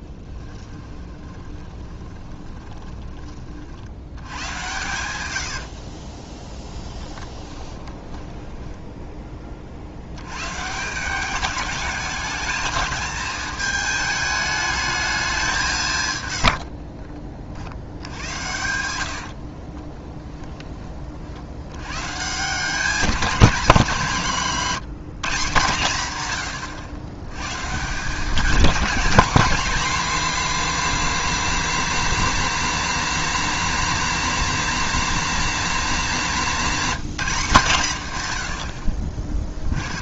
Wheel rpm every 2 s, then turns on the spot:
10, 20, 110, 10, 10, 160, 220, 210, 50, 80, 20, 190, 180, 120, 220, 250, 240, 240, 220, 60.
0-2 6-10 16-20